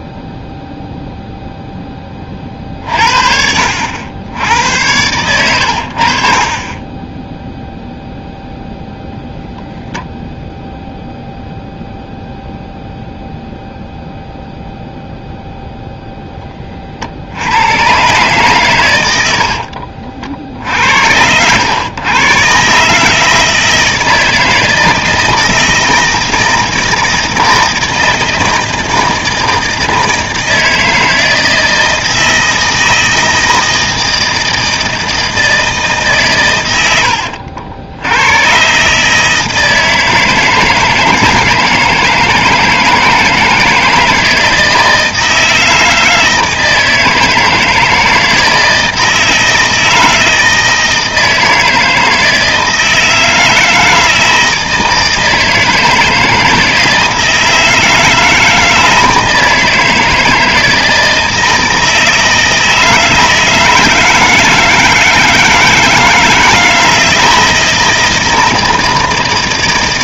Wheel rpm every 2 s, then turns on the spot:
0, 40, 90, 20, 0, 0, 0, 0, 10, 110, 60, 140, 160, 160, 160, 160, 160, 160, 110, 130, 160, 160, 160, 160, 160, 160, 160, 160, 160, 160, 160, 160, 160, 160, 160.
none